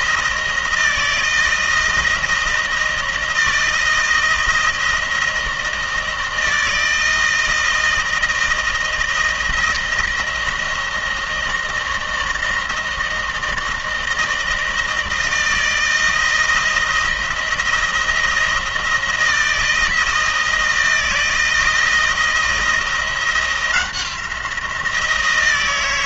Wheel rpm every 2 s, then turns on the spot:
160, 160, 160, 160, 160, 170, 160, 160, 160, 160, 160, 170, 170.
none